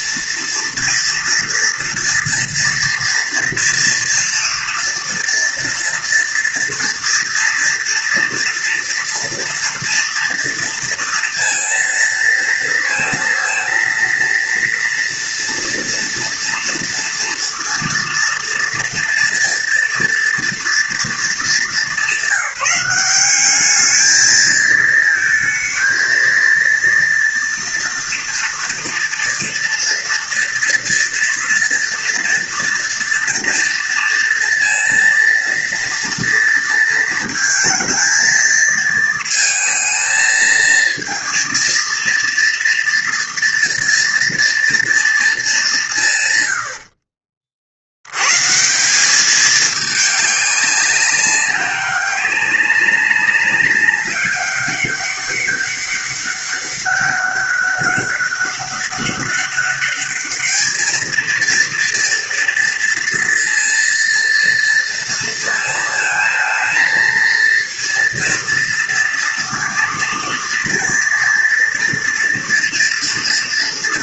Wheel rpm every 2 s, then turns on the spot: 230, 230, 230, 230, 240, 230, 230, 230, 230, 230, 230, 190, 220, 230, 230, 230, 230, 230, 230, 230, 230, 230, 230, 110, 140, 200, 190, 200, 200, 200, 210, 230, 230, 230, 230, 230, 230.
none